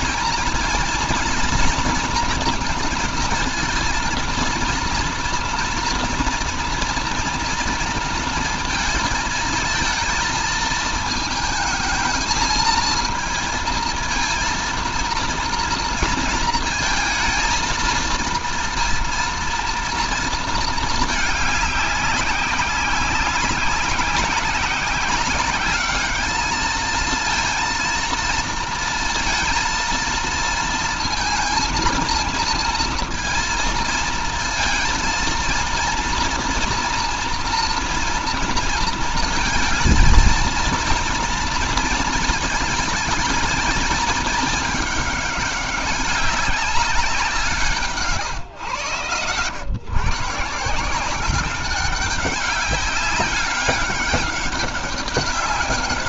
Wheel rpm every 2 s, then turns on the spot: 230, 230, 230, 230, 230, 220, 220, 230, 220, 230, 220, 190, 190, 220, 230, 230, 230, 230, 230, 230, 230, 220, 210, 190, 110, 160, 200, 200.
none